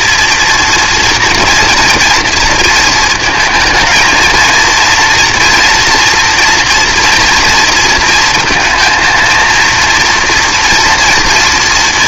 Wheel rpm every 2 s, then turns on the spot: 230, 230, 230, 230, 230, 240.
none